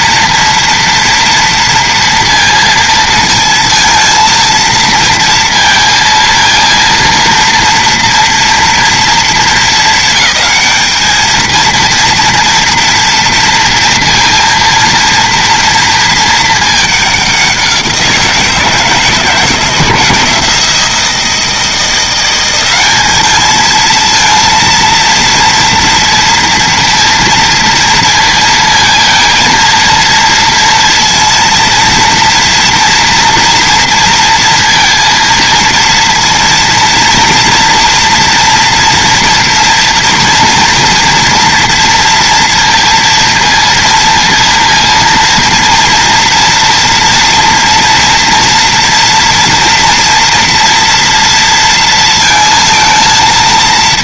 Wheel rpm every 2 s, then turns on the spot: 230, 230, 230, 230, 230, 220, 230, 230, 210, 160, 160, 190, 230, 230, 220, 230, 230, 230, 230, 230, 230, 230, 230, 230, 230, 230, 230.
none